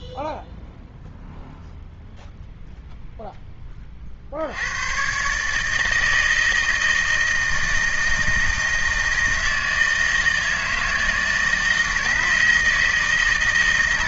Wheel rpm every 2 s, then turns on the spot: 0, 0, 110, 160, 160, 160, 160.
none